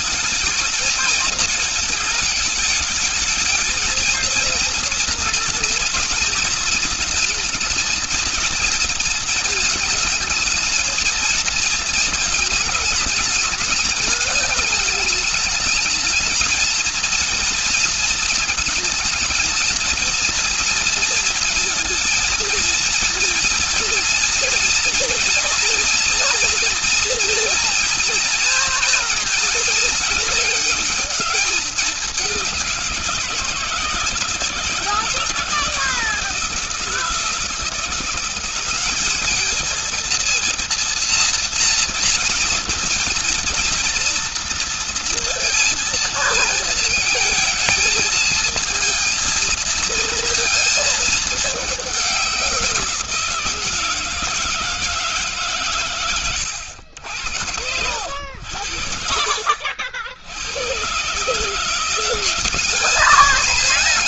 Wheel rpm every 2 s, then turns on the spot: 220, 220, 230, 230, 230, 220, 220, 220, 220, 220, 230, 230, 240, 230, 230, 210, 170, 150, 160, 190, 230, 230, 230, 230, 230, 220, 180, 160, 90, 70, 110, 200.
none